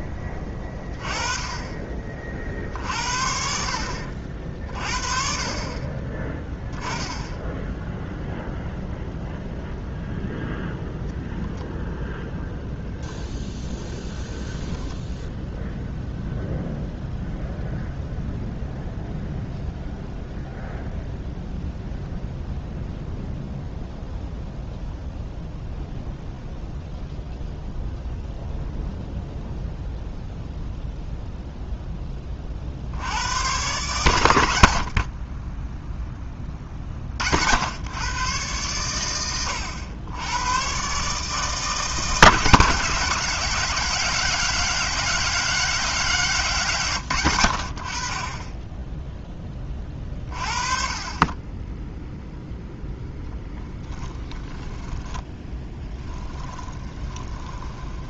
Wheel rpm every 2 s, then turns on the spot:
60, 40, 10, 0, 0, 0, 10, 0, 0, 0, 0, 0, 0, 0, 0, 10, 110, 0, 100, 100, 160, 190, 190, 60, 20, 10, 10, 10, 10.
52-58